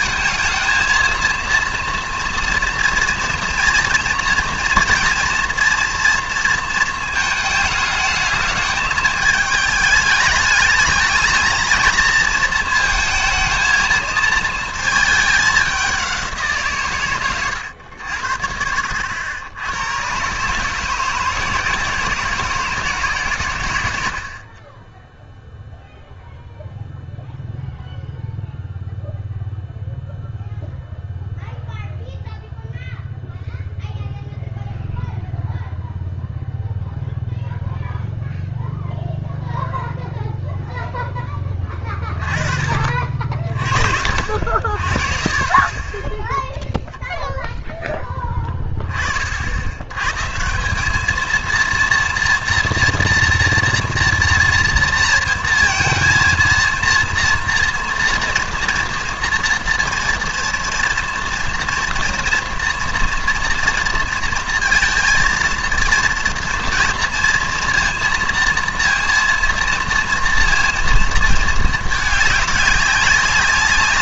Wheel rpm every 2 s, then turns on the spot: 230, 230, 230, 230, 220, 210, 230, 230, 150, 70, 150, 170, 30, 0, 0, 0, 0, 0, 0, 0, 0, 40, 50, 0, 20, 170, 230, 230, 230, 230, 230, 240, 230, 230, 230, 230, 200.
none